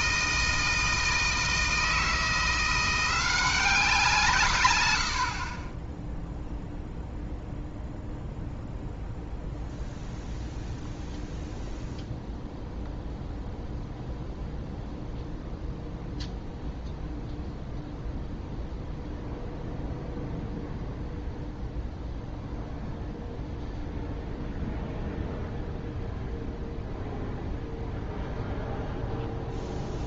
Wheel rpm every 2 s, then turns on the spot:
160, 180, 80, 0, 0, 0, 0, 0, 0, 0, 0, 0, 0, 0, 0.
none